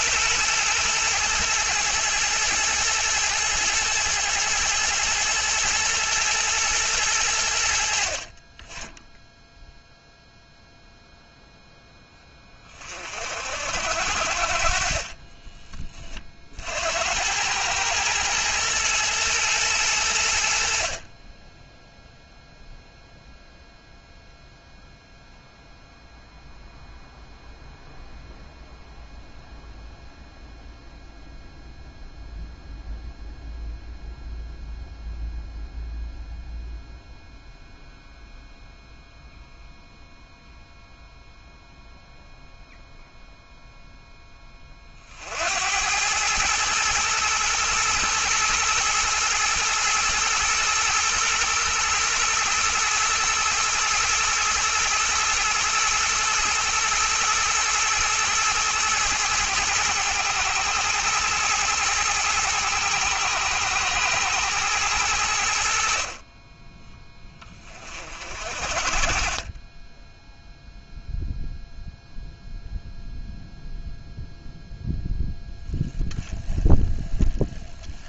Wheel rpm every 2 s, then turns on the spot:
110, 110, 110, 110, 10, 0, 40, 30, 90, 110, 40, 0, 0, 0, 0, 0, 0, 0, 0, 0, 0, 0, 50, 110, 110, 120, 120, 110, 120, 110, 120, 110, 100, 10, 30, 0, 0, 0, 10.
none